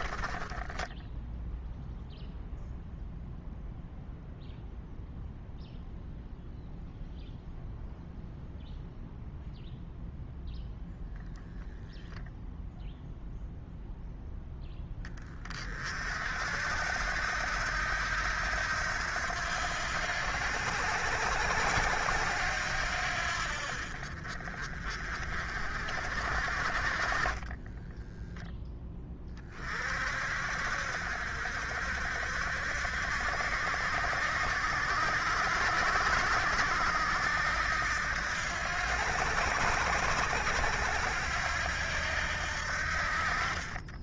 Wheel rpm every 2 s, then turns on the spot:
10, 0, 0, 0, 0, 0, 0, 20, 70, 80, 80, 80, 40, 40, 10, 60, 70, 70, 70, 80, 80, 70.
0-2